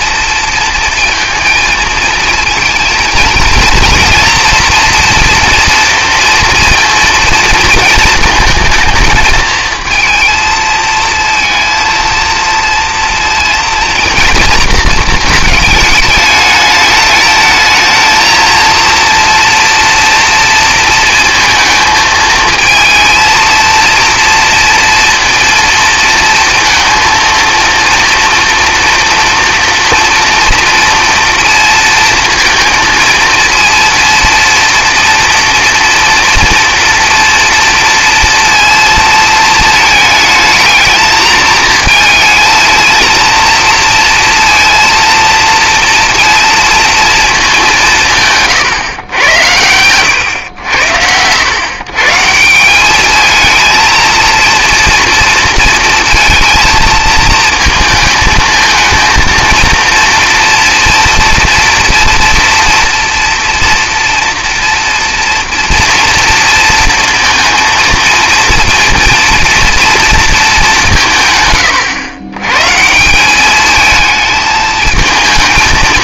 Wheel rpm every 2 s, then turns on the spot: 230, 230, 230, 230, 230, 230, 230, 230, 210, 230, 230, 220, 230, 230, 230, 230, 230, 230, 240, 230, 220, 220, 230, 230, 140, 90, 190, 230, 220, 220, 230, 230, 230, 230, 230, 190, 140, 220.
none